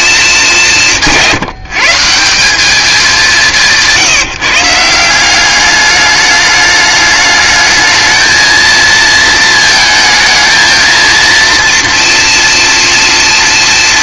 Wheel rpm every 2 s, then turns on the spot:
200, 200, 160, 210, 220, 220, 230.
none